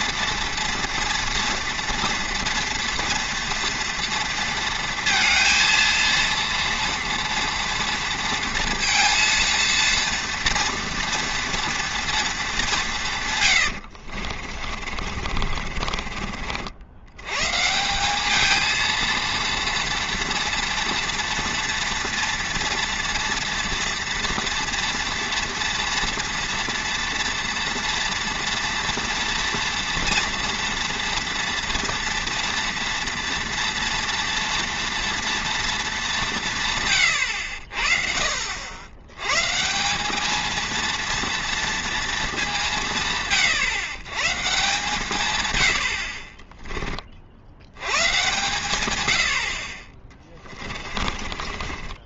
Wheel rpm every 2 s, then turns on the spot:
230, 230, 230, 230, 230, 230, 200, 50, 60, 220, 230, 230, 240, 240, 230, 230, 230, 230, 150, 70, 230, 190, 150, 20, 120, 20.
14-16 50-52